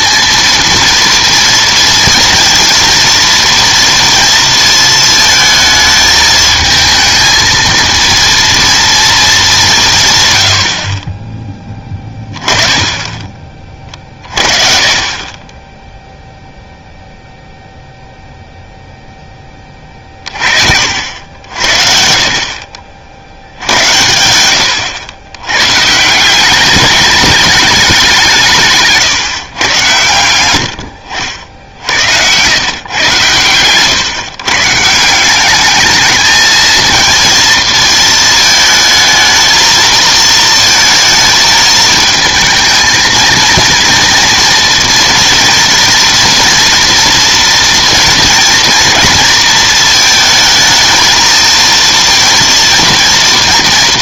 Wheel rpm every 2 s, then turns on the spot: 230, 230, 230, 220, 230, 60, 20, 30, 0, 0, 50, 40, 110, 200, 160, 80, 110, 140, 220, 220, 230, 220, 230, 230, 240, 220, 230.
none